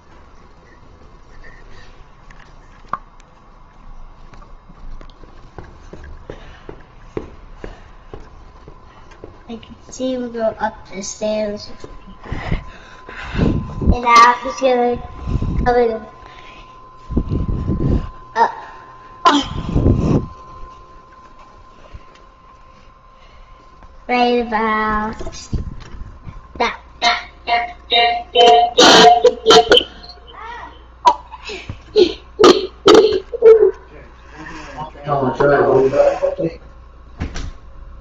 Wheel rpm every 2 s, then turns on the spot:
0, 0, 0, 0, 0, 0, 0, 0, 0, 0, 0, 0, 0, 0, 0, 0, 0, 0, 0.
none